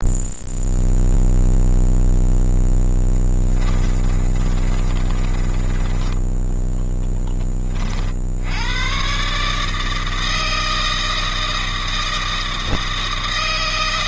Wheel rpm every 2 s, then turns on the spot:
0, 10, 20, 10, 140, 160, 160.
2-6